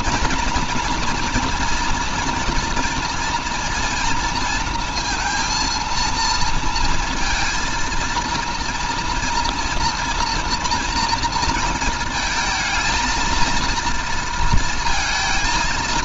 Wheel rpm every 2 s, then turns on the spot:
230, 230, 230, 230, 230, 240, 220, 230.
none